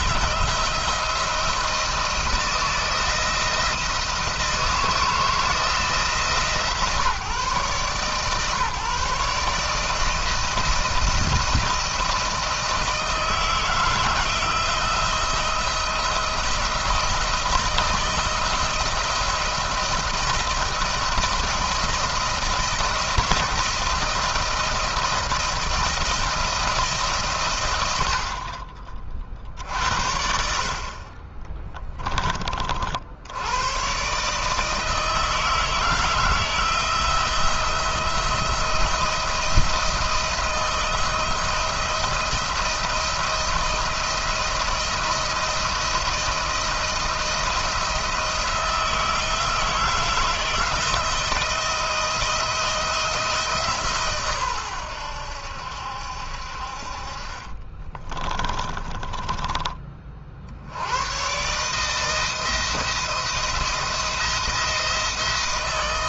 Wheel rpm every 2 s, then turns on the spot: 170, 170, 160, 150, 130, 160, 170, 170, 170, 170, 170, 170, 170, 160, 40, 60, 30, 150, 160, 170, 170, 170, 170, 170, 160, 160, 170, 130, 60, 20, 70, 160, 170.
58-60